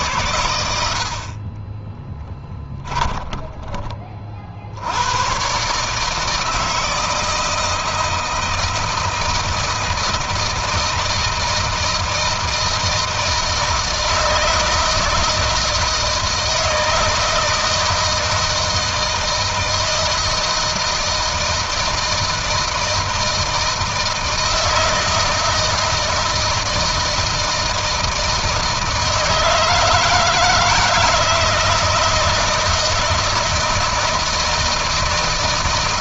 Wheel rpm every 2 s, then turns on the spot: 80, 10, 70, 160, 160, 160, 160, 160, 160, 160, 160, 160, 160, 160, 160, 160, 160, 160.
2-4